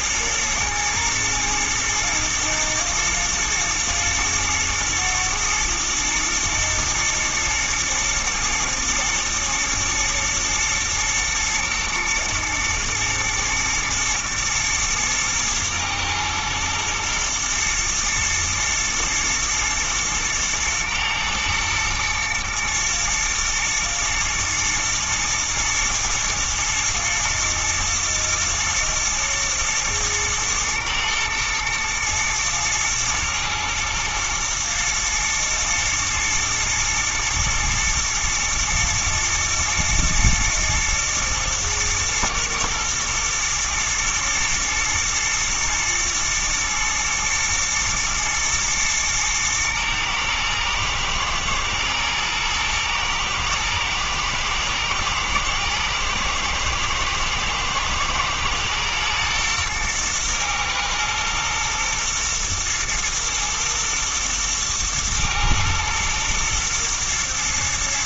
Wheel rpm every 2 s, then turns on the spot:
110, 110, 120, 120, 110, 110, 110, 110, 120, 110, 110, 120, 110, 120, 110, 110, 110, 110, 110, 110, 110, 110, 120, 120, 110, 120, 120, 110, 110, 110, 110, 110, 110, 110.
none